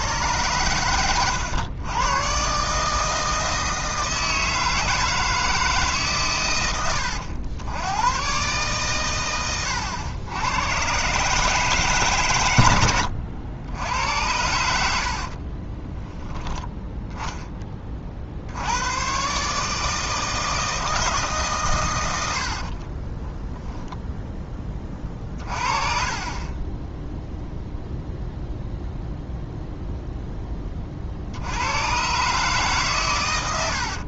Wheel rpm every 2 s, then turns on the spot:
110, 140, 160, 110, 130, 120, 90, 80, 10, 90, 160, 60, 30, 20, 0, 30, 140.
14-16 22-24